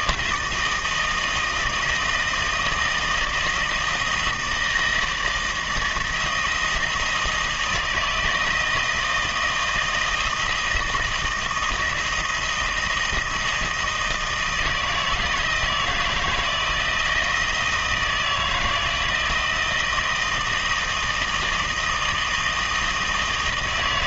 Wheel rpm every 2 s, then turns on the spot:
160, 160, 160, 170, 160, 160, 160, 160, 160, 160, 160, 160.
none